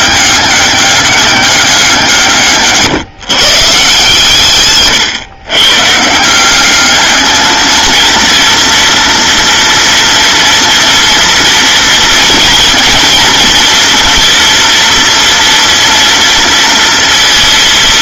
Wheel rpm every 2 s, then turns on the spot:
200, 150, 130, 210, 240, 240, 230, 230, 230.
none